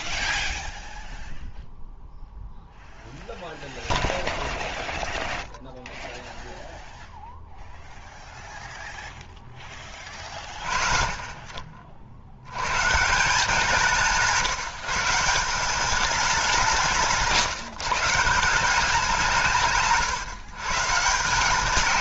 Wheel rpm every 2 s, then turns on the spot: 0, 0, 0, 0, 0, 40, 100, 160, 170, 180, 140.
none